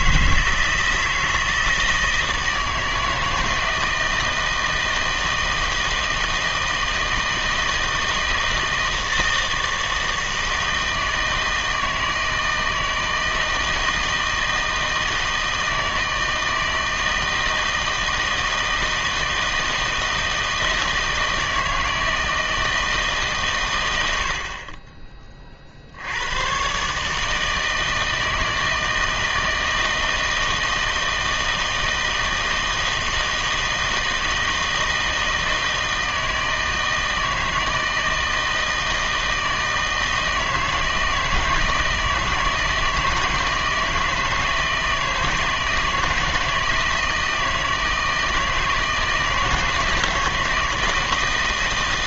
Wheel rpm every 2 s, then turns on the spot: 160, 160, 160, 160, 160, 160, 160, 160, 160, 160, 160, 160, 40, 130, 160, 160, 160, 160, 160, 160, 160, 160, 160, 160, 160, 160.
none